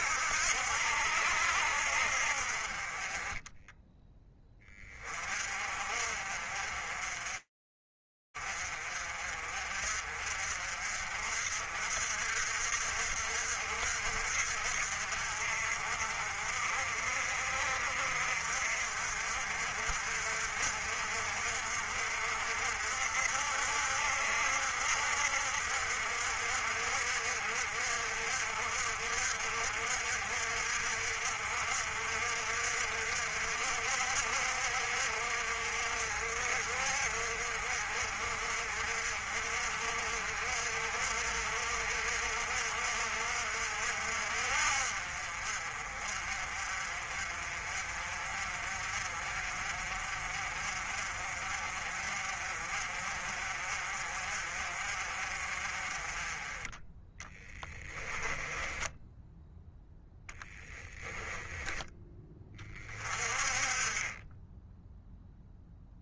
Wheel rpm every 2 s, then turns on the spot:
70, 30, 30, 40, 50, 60, 60, 50, 50, 60, 60, 60, 60, 60, 60, 60, 60, 60, 60, 50, 60, 60, 50, 40, 50, 50, 50, 50, 10, 10, 10, 30, 0.
56-60